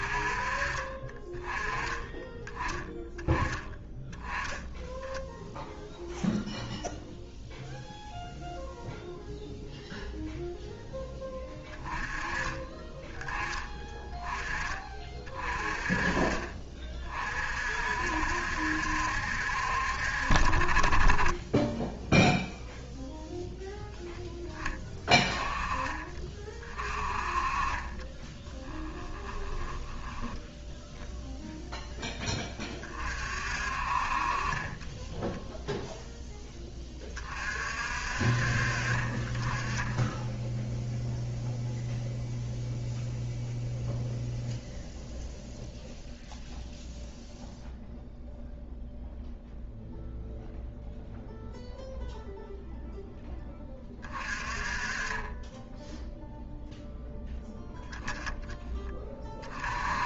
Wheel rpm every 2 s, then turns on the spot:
30, 10, 0, 0, 0, 10, 20, 30, 30, 70, 50, 0, 20, 40, 10, 0, 30, 20, 20, 40, 0, 0, 0, 0, 0, 0, 0, 30, 0, 20.
28-30 34-36